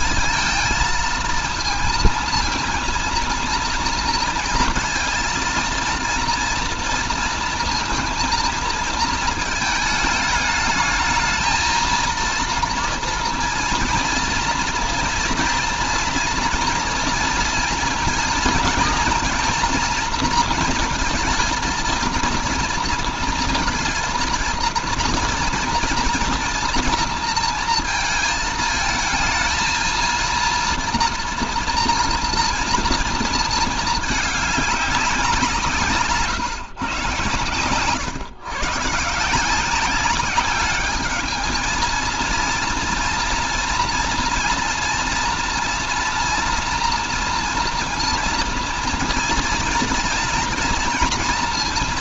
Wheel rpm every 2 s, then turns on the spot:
230, 230, 230, 230, 230, 220, 240, 230, 240, 230, 220, 230, 230, 230, 220, 230, 230, 200, 120, 140, 200, 230, 240, 240, 230, 240.
none